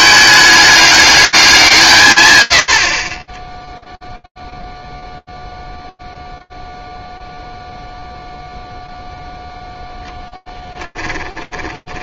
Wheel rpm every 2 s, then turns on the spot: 210, 40, 0, 0, 0, 20.
10-12